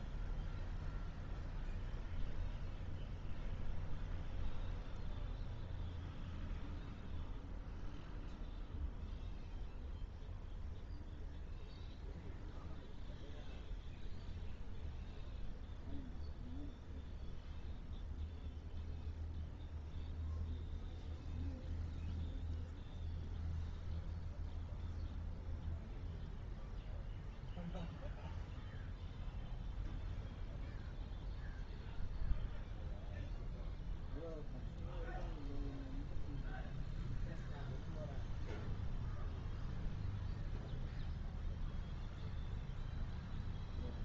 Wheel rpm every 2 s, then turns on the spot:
0, 0, 0, 0, 0, 0, 0, 0, 0, 0, 0, 0, 0, 0, 0, 0, 0, 0, 0, 0, 0, 0.
none